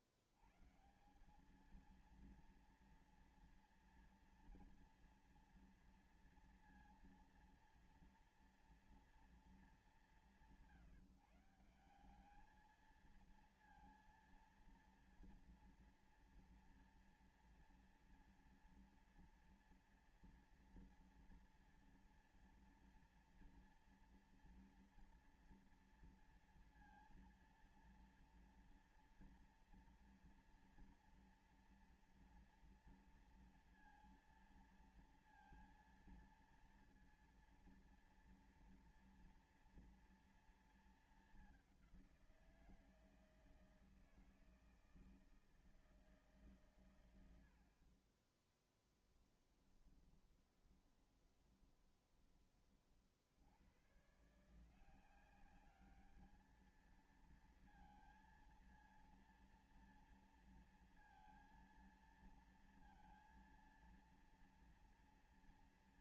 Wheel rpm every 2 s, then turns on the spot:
100, 230, 240, 230, 240, 180, 200, 230, 230, 230, 230, 230, 230, 230, 230, 230, 230, 230, 230, 230, 230, 180, 160, 140, 20, 20, 20, 140, 220, 230, 230, 230, 230.
48-52